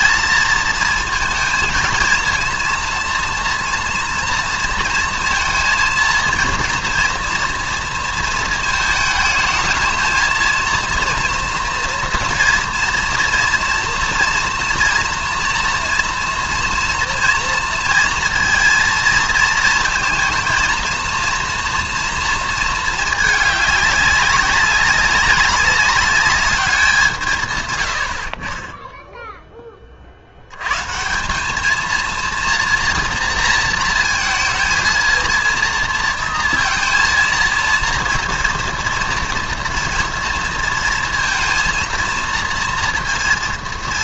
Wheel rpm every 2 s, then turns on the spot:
230, 230, 230, 230, 220, 230, 230, 230, 230, 230, 230, 220, 190, 190, 30, 110, 230, 220, 230, 230, 230, 230.
none